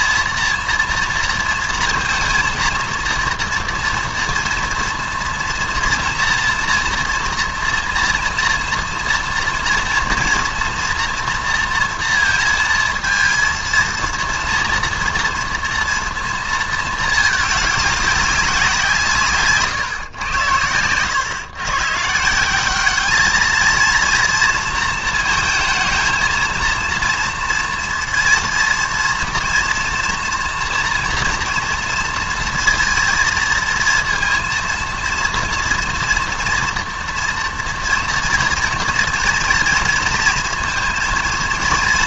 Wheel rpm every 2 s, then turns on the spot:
230, 230, 230, 230, 230, 230, 230, 230, 230, 180, 100, 180, 230, 230, 230, 240, 230, 230, 230, 230, 230.
none